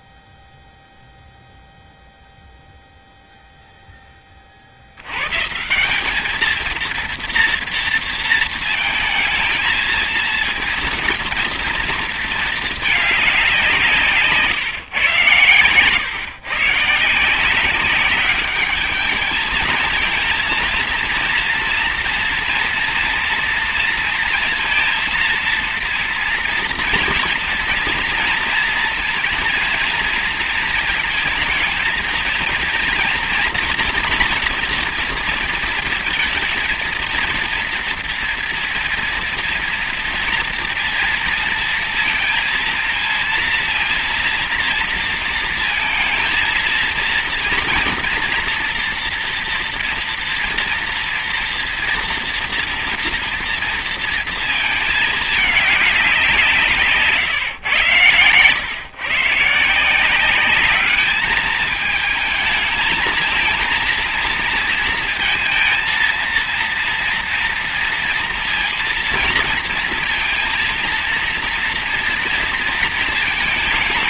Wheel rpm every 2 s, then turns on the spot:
0, 0, 110, 230, 220, 230, 210, 130, 150, 210, 230, 240, 230, 220, 230, 220, 230, 230, 230, 240, 230, 230, 230, 230, 230, 230, 230, 210, 150, 110, 200, 230, 230, 230, 230, 230, 230.
none